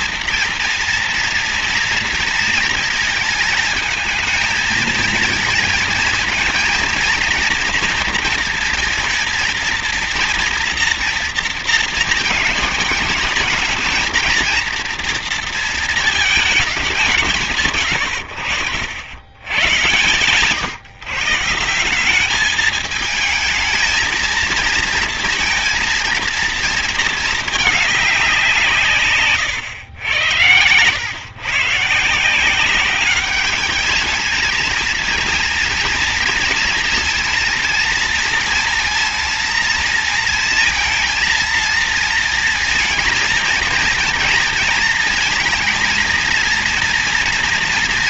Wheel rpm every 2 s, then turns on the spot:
230, 230, 220, 240, 230, 230, 220, 230, 200, 100, 140, 220, 230, 230, 150, 110, 200, 230, 230, 230, 230, 230, 230, 230.
none